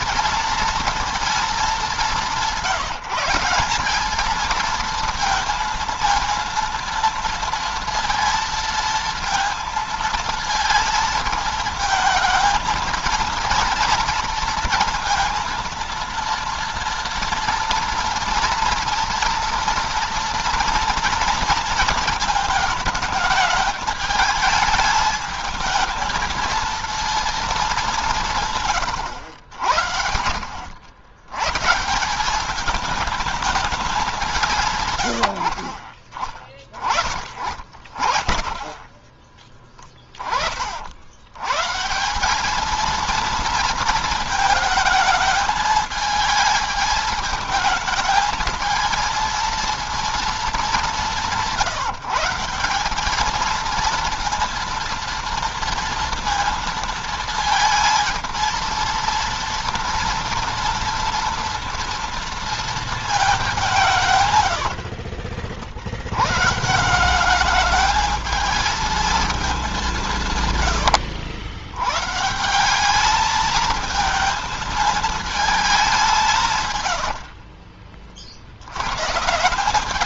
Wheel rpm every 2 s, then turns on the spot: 230, 170, 220, 230, 230, 220, 220, 230, 230, 230, 240, 220, 210, 230, 120, 80, 210, 130, 20, 20, 70, 220, 220, 220, 220, 200, 190, 230, 230, 230, 230, 220, 50, 170, 220, 100, 200, 220, 100, 110.
64-66 70-72 76-78